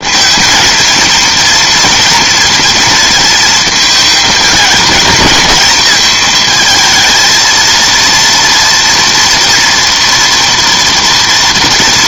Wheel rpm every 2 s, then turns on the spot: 230, 230, 210, 220, 230, 230.
none